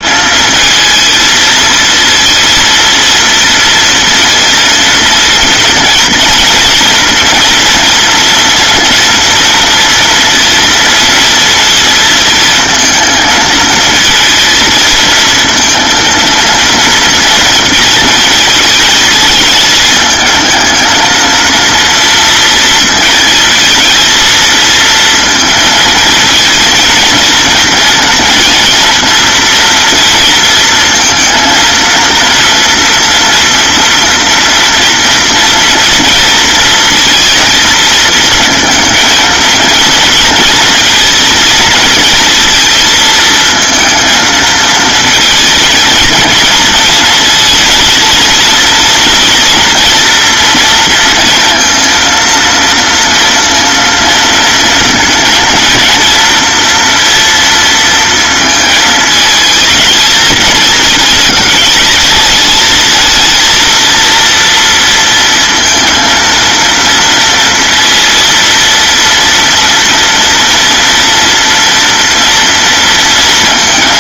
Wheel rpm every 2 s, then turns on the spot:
220, 230, 230, 230, 230, 230, 230, 230, 230, 220, 230, 230, 230, 230, 230, 230, 240, 230, 230, 220, 230, 230, 230, 230, 230, 230, 230, 230, 240, 220, 220, 220, 230, 230, 230, 230, 230.
none